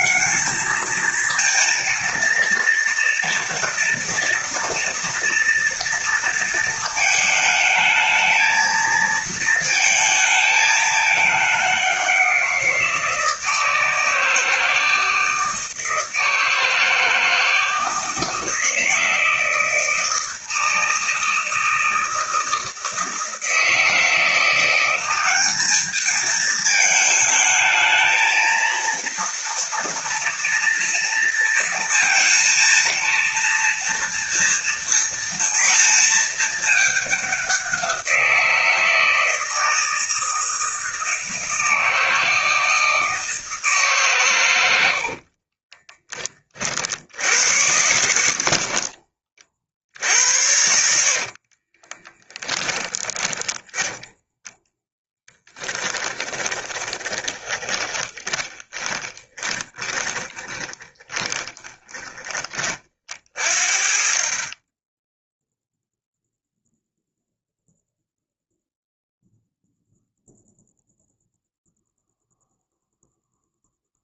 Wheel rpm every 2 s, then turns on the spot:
210, 230, 230, 220, 220, 220, 170, 160, 160, 160, 160, 160, 180, 220, 230, 230, 230, 230, 210, 170, 160, 160, 100, 50, 50, 70, 20, 10, 20, 10, 10, 30, 20, 0, 0, 0, 0.
48-52 54-62